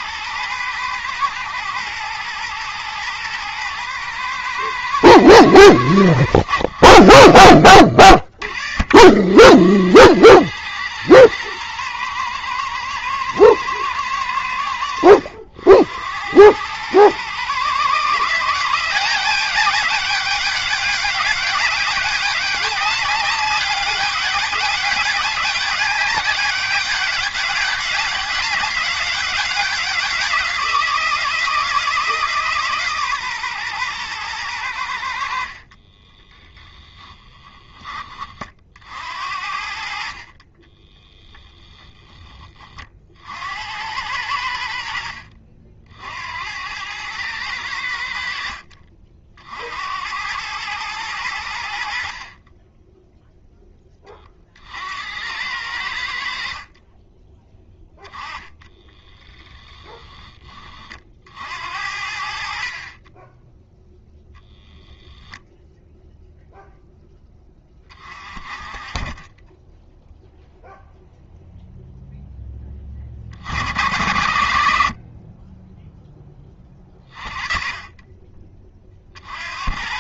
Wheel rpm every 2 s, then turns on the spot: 120, 110, 110, 60, 60, 110, 110, 90, 130, 190, 200, 200, 200, 200, 190, 170, 140, 70, 10, 60, 10, 40, 70, 100, 50, 100, 10, 70, 30, 10, 50, 20, 0, 0, 20, 0, 40, 60, 30, 40.
36-38 40-42 58-60